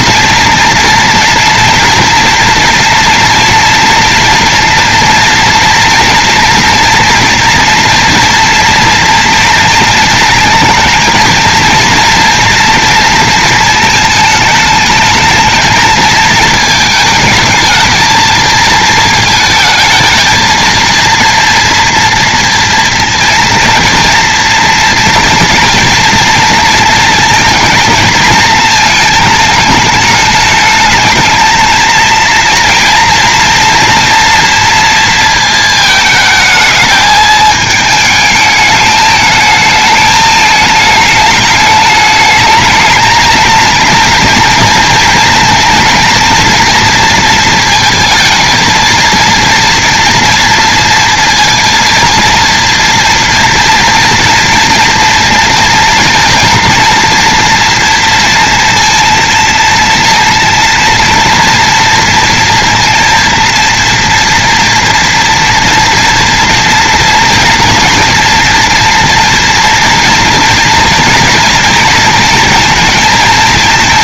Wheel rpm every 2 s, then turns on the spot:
240, 230, 230, 230, 230, 230, 230, 210, 220, 220, 230, 230, 230, 230, 230, 210, 230, 230, 220, 210, 210, 220, 230, 230, 230, 230, 230, 240, 230, 230, 230, 230, 230, 230, 230, 230, 230.
none